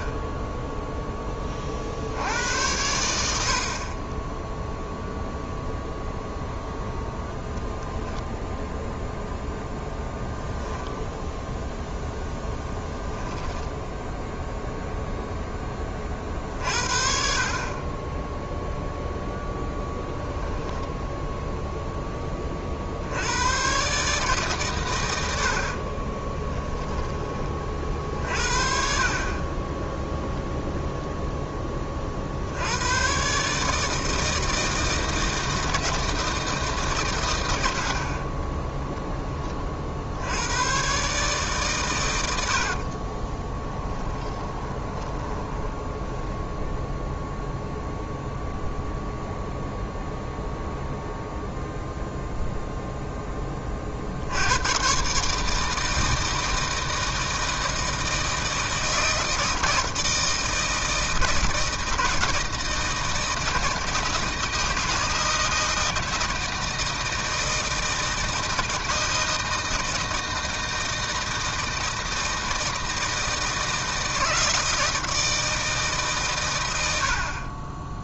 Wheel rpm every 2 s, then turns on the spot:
10, 100, 10, 0, 0, 0, 0, 0, 50, 0, 10, 40, 140, 10, 50, 0, 70, 160, 150, 10, 100, 80, 20, 0, 0, 0, 0, 90, 160, 160, 160, 160, 160, 160, 160, 160, 160, 160, 120.
26-28 42-46